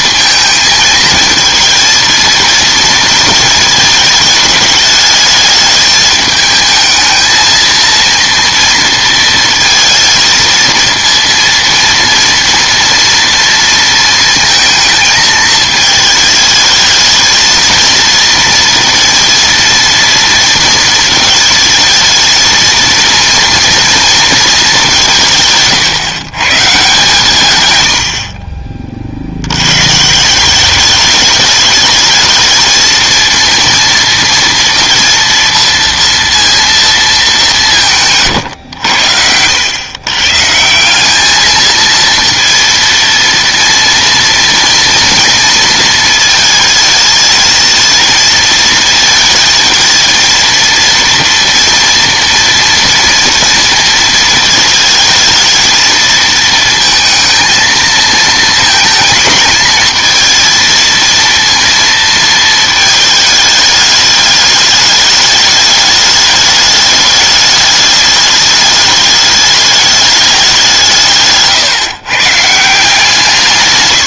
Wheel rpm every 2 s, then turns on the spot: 220, 230, 210, 220, 230, 230, 230, 230, 220, 230, 230, 230, 210, 140, 40, 200, 220, 230, 230, 100, 160, 230, 230, 220, 230, 230, 230, 220, 230, 230, 230, 220, 210, 210, 210, 190, 160.
none